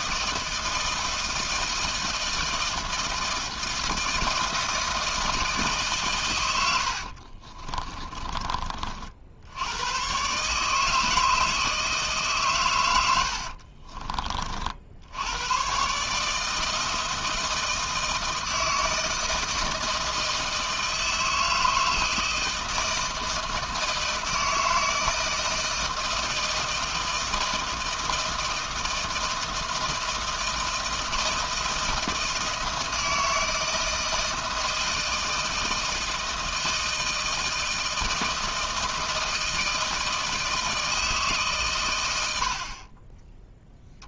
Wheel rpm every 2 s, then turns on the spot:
160, 160, 160, 90, 40, 150, 120, 50, 160, 160, 160, 160, 160, 160, 160, 160, 160, 160, 160, 160, 160, 60.
6-8